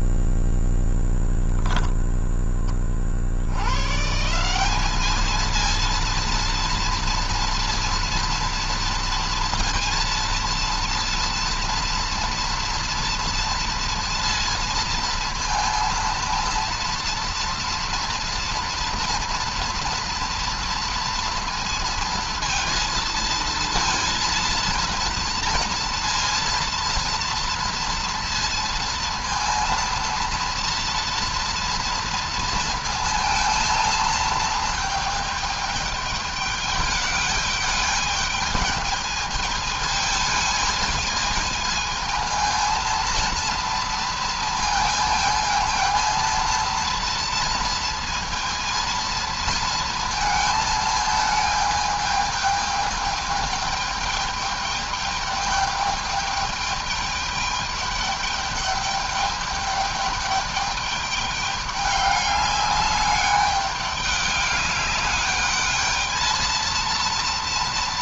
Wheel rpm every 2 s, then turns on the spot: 0, 10, 140, 230, 230, 230, 230, 230, 230, 230, 230, 230, 230, 230, 230, 230, 230, 220, 210, 220, 220, 230, 230, 230, 230, 220, 220, 210, 210, 210, 210, 200, 200, 230.
none